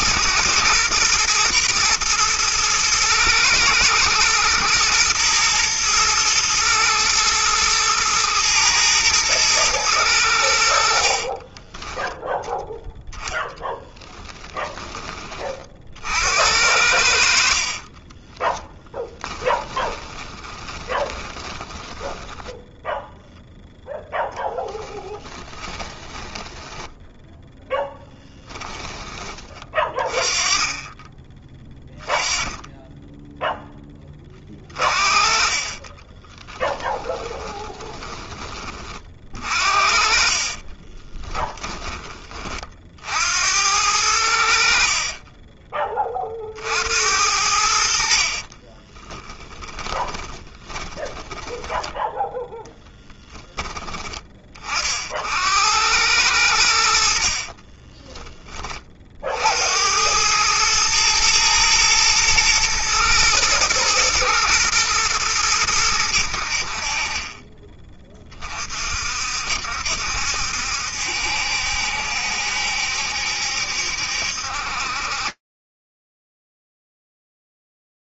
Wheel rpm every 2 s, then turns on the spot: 110, 110, 120, 110, 110, 60, 10, 10, 70, 10, 10, 0, 10, 10, 10, 20, 10, 30, 20, 30, 30, 40, 60, 60, 20, 10, 10, 40, 70, 30, 110, 120, 120, 50, 40, 70, 70, 50, 0.
18-22 24-28 34-38 40-42 44-46 48-54